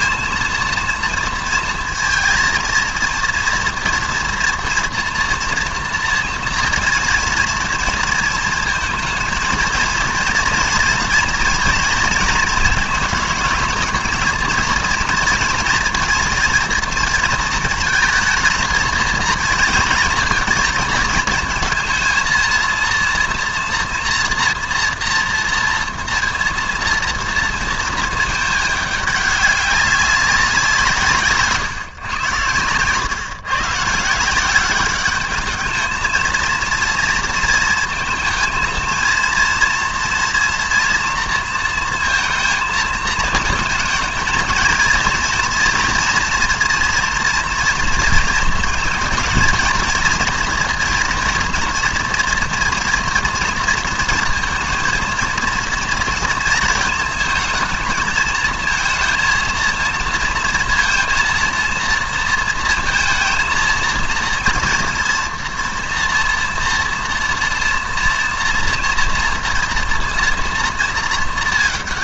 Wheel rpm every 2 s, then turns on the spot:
230, 230, 230, 230, 220, 230, 230, 230, 230, 220, 220, 230, 240, 230, 210, 180, 120, 190, 230, 230, 230, 220, 230, 240, 220, 230, 230, 230, 230, 220, 230, 230, 230, 230, 230, 230.
none